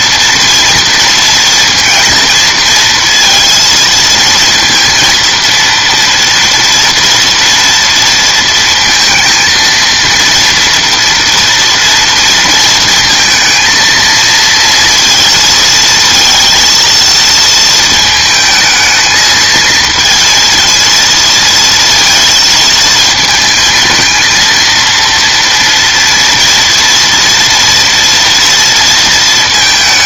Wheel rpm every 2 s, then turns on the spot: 230, 230, 230, 230, 230, 230, 230, 230, 230, 220, 230, 230, 230, 230, 230.
none